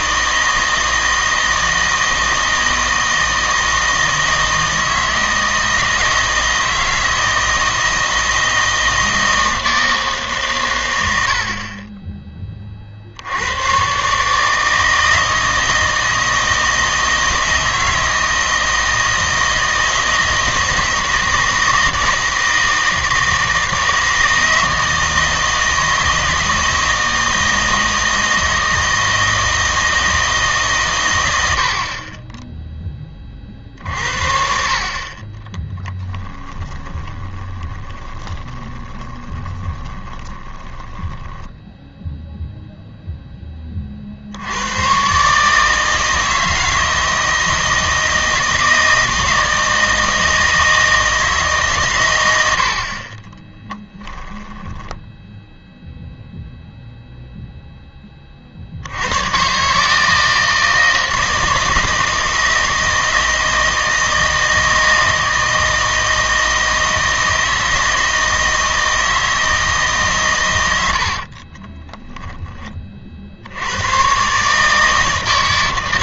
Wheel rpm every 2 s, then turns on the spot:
160, 160, 160, 160, 160, 110, 30, 160, 160, 160, 160, 160, 160, 160, 160, 140, 10, 40, 20, 20, 20, 0, 100, 160, 160, 160, 50, 10, 0, 50, 160, 160, 160, 160, 160, 100, 30, 150.
36-42 52-56